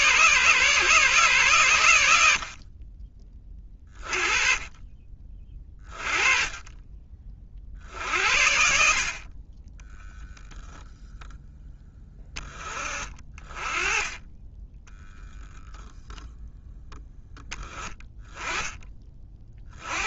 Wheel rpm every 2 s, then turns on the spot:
140, 30, 30, 30, 50, 0, 30, 0, 10, 20.
none